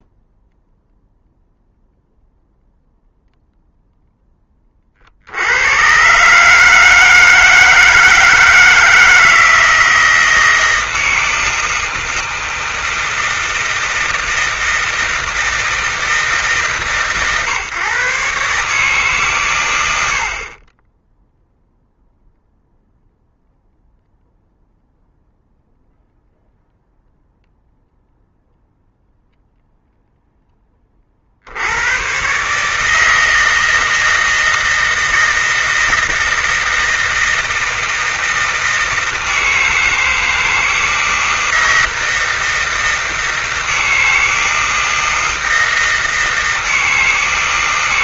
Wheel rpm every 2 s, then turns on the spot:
0, 0, 20, 150, 160, 160, 160, 160, 150, 150, 40, 0, 0, 0, 0, 20, 150, 160, 160, 160, 160, 160, 160, 160.
none